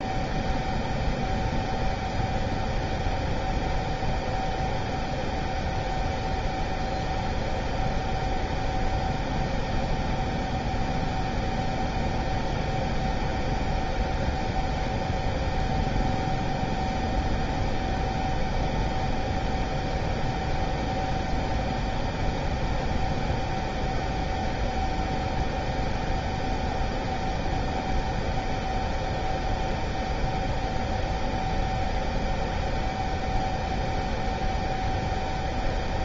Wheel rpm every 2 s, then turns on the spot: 0, 0, 0, 0, 0, 0, 0, 0, 0, 0, 0, 0, 0, 0, 0, 0, 0, 0.
none